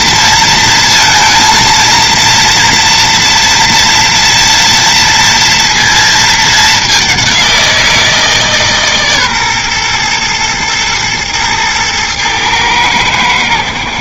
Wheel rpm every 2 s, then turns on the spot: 230, 230, 230, 210, 150, 110, 110.
none